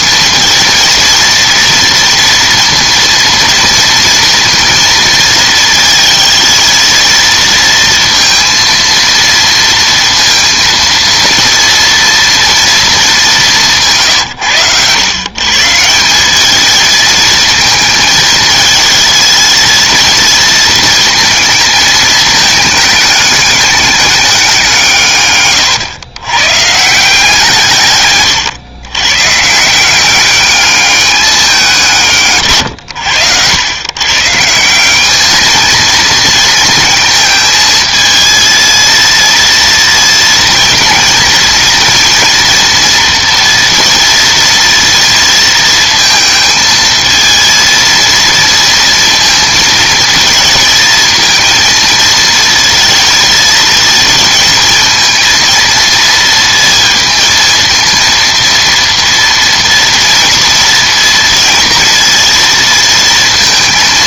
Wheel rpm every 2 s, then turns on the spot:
230, 230, 230, 230, 230, 230, 220, 110, 220, 230, 230, 210, 160, 150, 120, 210, 110, 200, 220, 230, 220, 230, 230, 220, 230, 220, 230, 230, 220, 230, 230, 230.
none